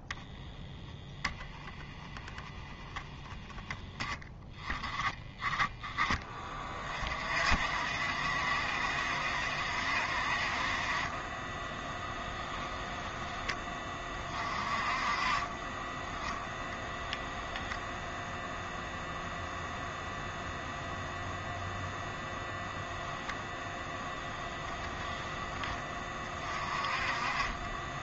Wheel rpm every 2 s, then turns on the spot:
10, 10, 10, 30, 70, 50, 10, 30, 0, 0, 0, 0, 0, 30.
none